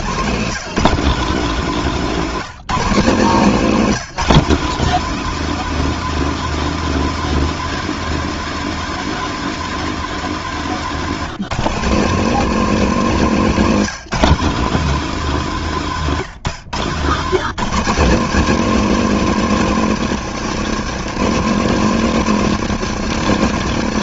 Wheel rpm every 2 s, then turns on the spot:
200, 180, 220, 220, 220, 160, 180, 200, 160, 220, 210, 190.
none